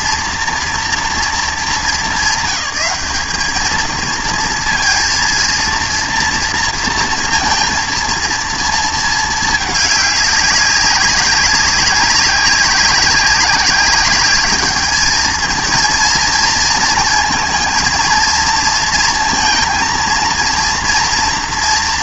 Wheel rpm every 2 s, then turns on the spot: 230, 210, 230, 230, 230, 200, 190, 210, 220, 230, 230.
none